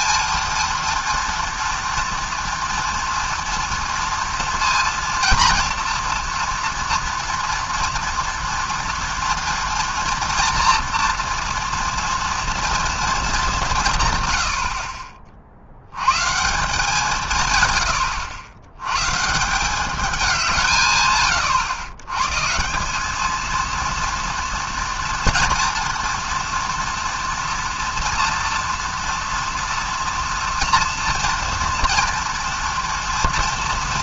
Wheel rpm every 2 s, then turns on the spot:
230, 230, 230, 230, 240, 230, 230, 80, 150, 100, 170, 150, 230, 230, 240, 230, 230.
none